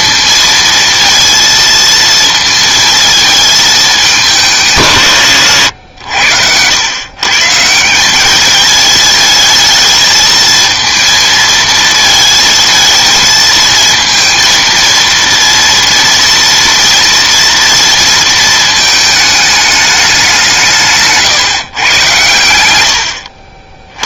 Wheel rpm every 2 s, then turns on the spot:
230, 230, 160, 90, 210, 220, 220, 230, 230, 220, 170, 100.
none